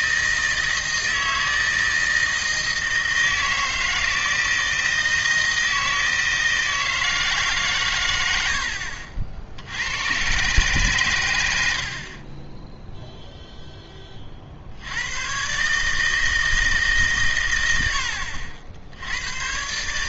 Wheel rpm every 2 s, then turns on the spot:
160, 160, 160, 160, 70, 130, 10, 70, 160, 70.
8-10